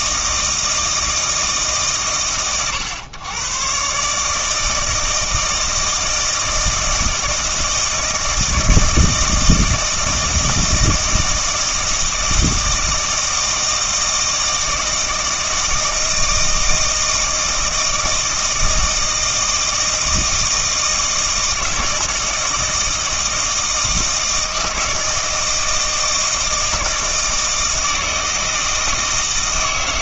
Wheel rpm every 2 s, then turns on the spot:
160, 100, 160, 160, 160, 160, 160, 160, 160, 160, 160, 160, 160, 160, 160.
none